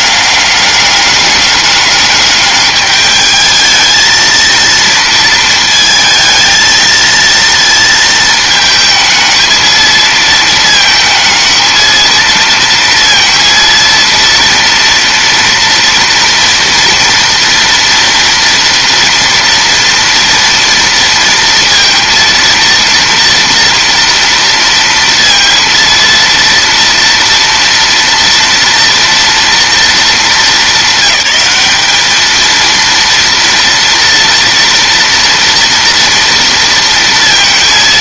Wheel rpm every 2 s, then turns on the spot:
200, 210, 230, 220, 220, 220, 230, 230, 230, 230, 230, 230, 230, 230, 230, 200, 220, 230, 230.
none